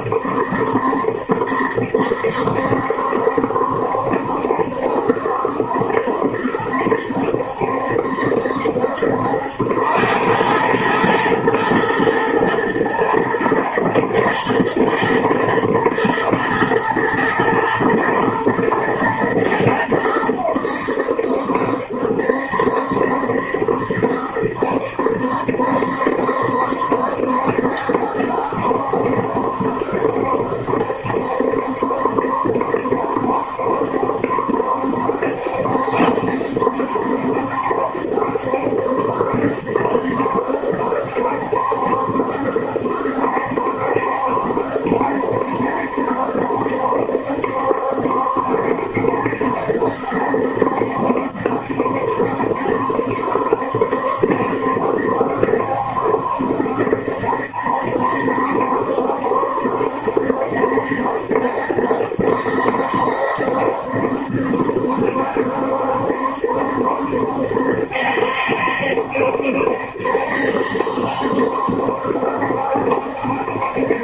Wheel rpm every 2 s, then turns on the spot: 70, 70, 70, 70, 70, 110, 110, 110, 120, 120, 80, 70, 70, 70, 70, 70, 70, 70, 70, 70, 70, 70, 70, 70, 70, 70, 70, 70, 70, 70, 70, 70, 70, 70, 70, 70, 70.
none